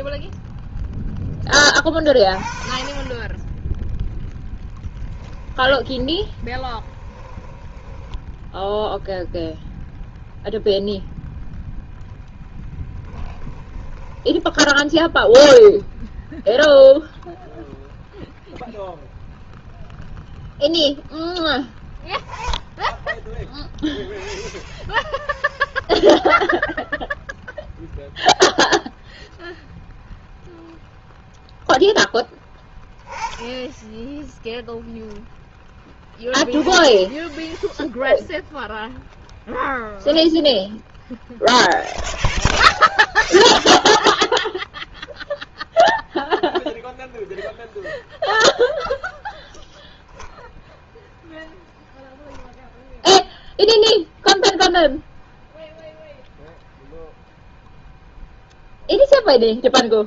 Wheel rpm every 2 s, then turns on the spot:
0, 20, 10, 20, 0, 0, 10, 10, 0, 0, 0, 10, 0, 0, 0, 0, 10, 0, 10, 0, 0, 0, 0, 0, 0, 10, 0, 0, 0, 0.
4-8 12-14